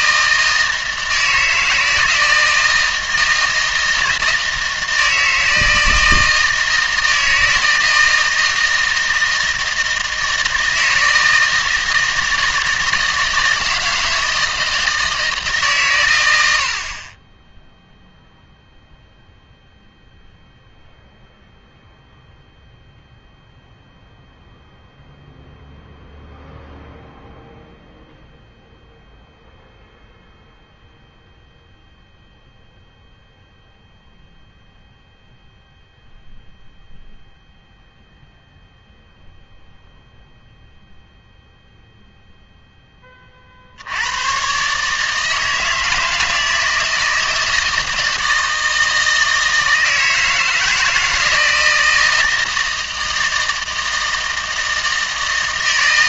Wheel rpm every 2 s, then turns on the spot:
160, 160, 160, 160, 160, 160, 160, 160, 60, 0, 0, 0, 0, 0, 0, 0, 0, 0, 0, 0, 0, 10, 140, 160, 160, 160, 160, 160.
none